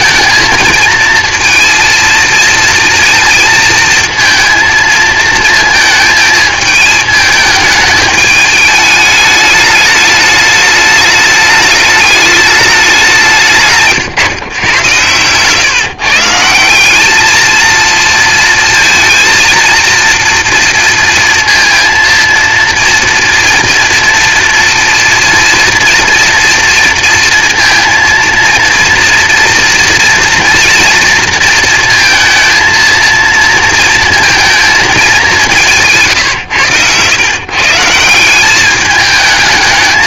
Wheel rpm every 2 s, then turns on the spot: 230, 230, 230, 220, 210, 210, 200, 120, 180, 230, 230, 230, 230, 230, 230, 230, 230, 220, 110, 190.
none